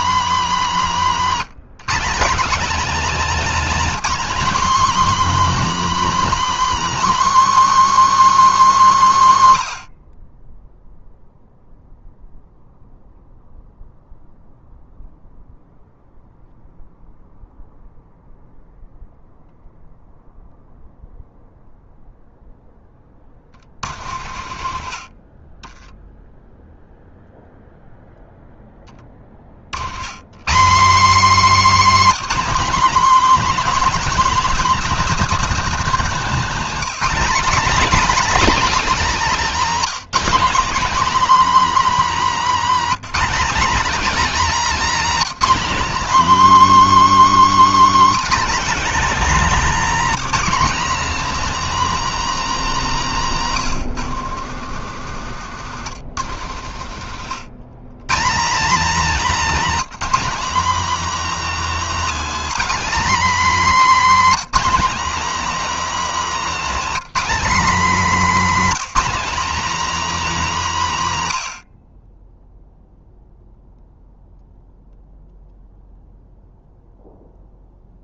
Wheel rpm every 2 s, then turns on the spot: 260, 260, 290, 310, 290, 20, 0, 0, 0, 0, 0, 10, 60, 0, 10, 200, 280, 280, 250, 290, 270, 270, 280, 300, 270, 280, 270, 110, 80, 230, 270, 290, 280, 270, 260, 240, 0, 0, 0.
24-26 36-38 54-58